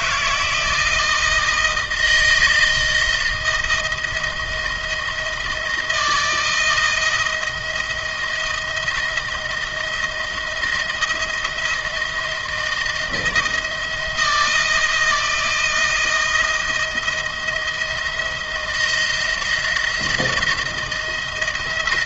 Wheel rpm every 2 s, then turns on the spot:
160, 160, 170, 160, 160, 170, 160, 160, 160, 170, 160.
none